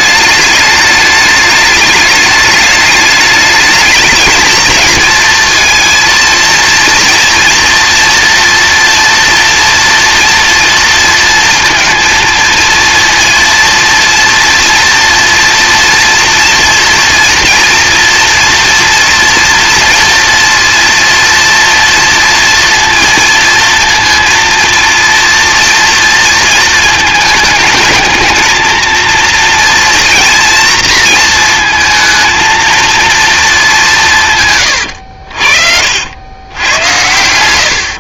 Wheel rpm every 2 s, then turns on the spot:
210, 210, 220, 230, 230, 230, 230, 230, 230, 230, 230, 230, 230, 220, 230, 230, 230, 120, 100.
34-36